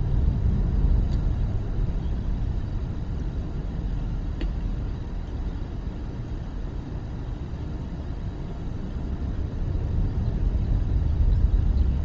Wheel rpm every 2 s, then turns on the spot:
0, 0, 0, 0, 0, 0.
none